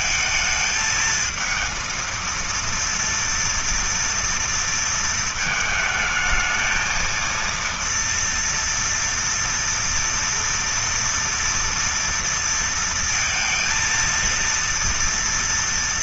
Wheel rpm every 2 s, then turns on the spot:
220, 230, 220, 230, 230, 230, 230, 240.
none